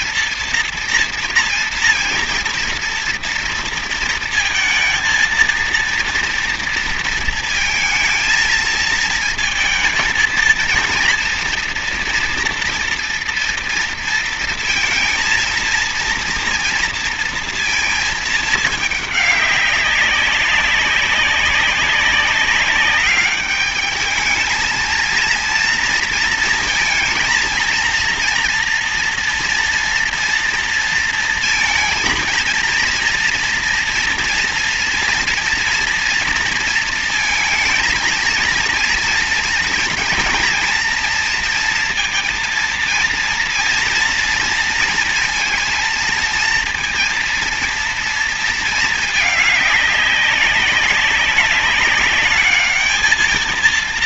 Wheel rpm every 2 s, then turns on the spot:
230, 230, 220, 230, 230, 220, 230, 230, 230, 220, 200, 200, 220, 230, 230, 230, 230, 240, 230, 220, 230, 230, 230, 230, 230, 200, 210.
none